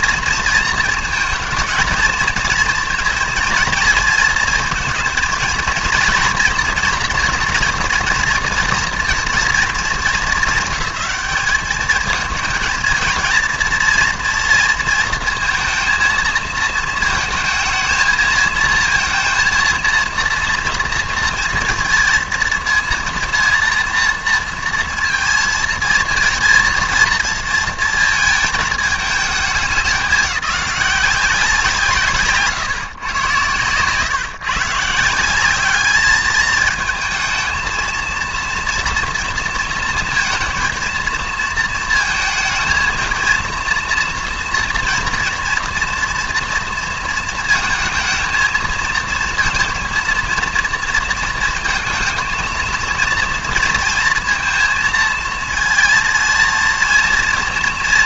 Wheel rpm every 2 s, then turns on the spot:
230, 230, 230, 230, 230, 210, 220, 230, 220, 220, 230, 230, 230, 230, 220, 190, 140, 140, 220, 230, 230, 230, 230, 230, 220, 230, 230, 230, 230.
none